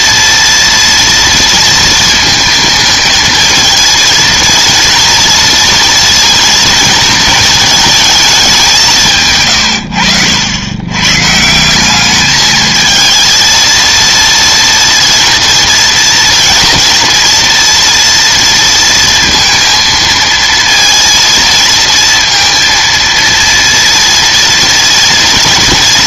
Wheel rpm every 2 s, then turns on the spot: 230, 220, 230, 230, 190, 90, 220, 230, 230, 230, 230, 230, 230.
none